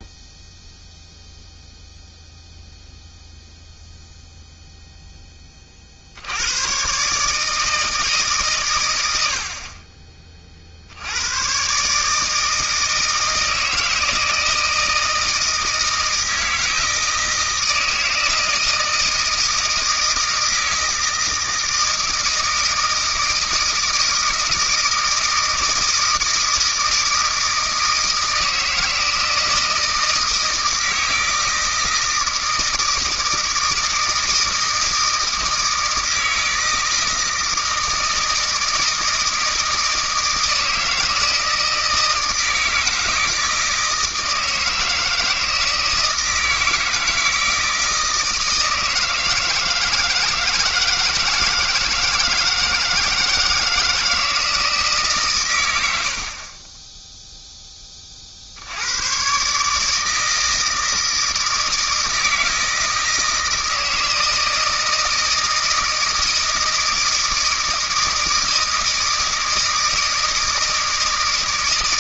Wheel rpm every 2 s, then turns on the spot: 0, 0, 0, 110, 130, 50, 160, 160, 160, 160, 160, 160, 160, 160, 160, 160, 160, 160, 160, 160, 160, 160, 160, 160, 160, 160, 160, 160, 30, 70, 160, 160, 160, 160, 160, 160.
none